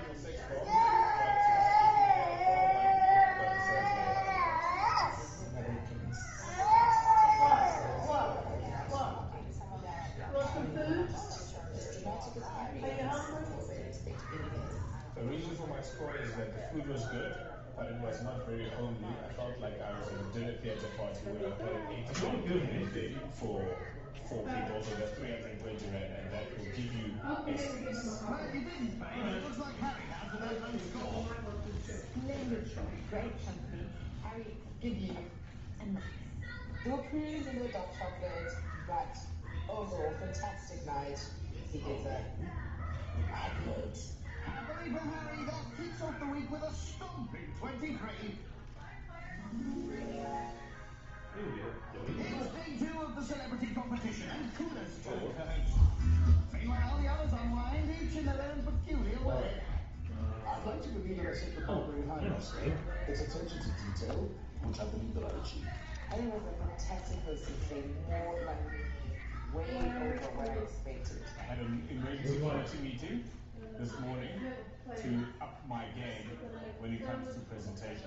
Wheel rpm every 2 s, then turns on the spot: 0, 0, 0, 0, 0, 0, 0, 0, 0, 0, 0, 0, 0, 0, 0, 0, 0, 0, 0, 0, 0, 0, 0, 0, 0, 0, 0, 0, 0, 0, 0, 0, 0, 0, 0, 0, 0, 0, 0.
none